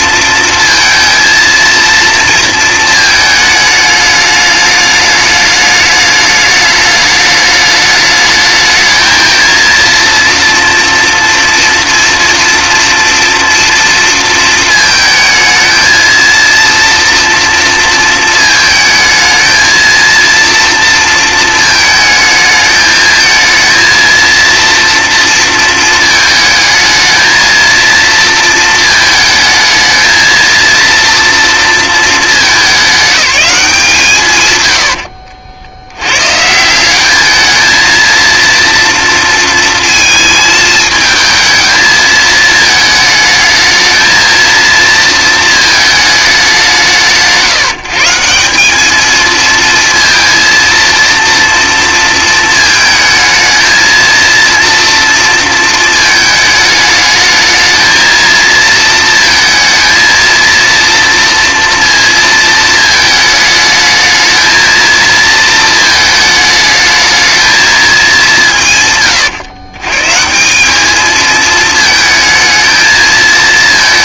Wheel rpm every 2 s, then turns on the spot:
230, 220, 210, 210, 220, 230, 230, 220, 230, 220, 230, 220, 230, 220, 220, 230, 210, 110, 180, 230, 220, 220, 230, 180, 200, 230, 220, 230, 210, 230, 230, 220, 220, 220, 150, 200, 220.
none